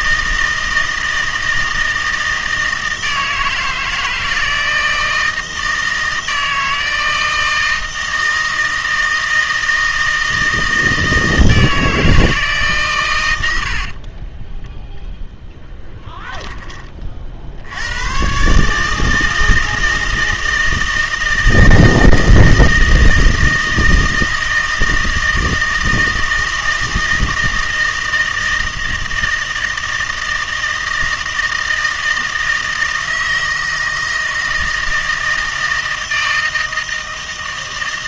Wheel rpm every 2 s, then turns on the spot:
160, 160, 160, 160, 160, 160, 140, 0, 20, 140, 160, 160, 160, 160, 160, 160, 160, 160, 160.
none